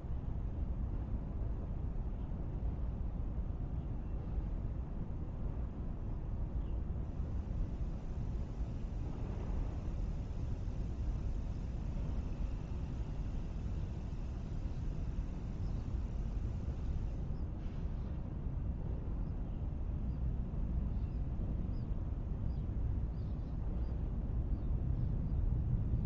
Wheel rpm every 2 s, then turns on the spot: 0, 0, 0, 0, 0, 0, 0, 0, 0, 0, 0, 0, 0.
none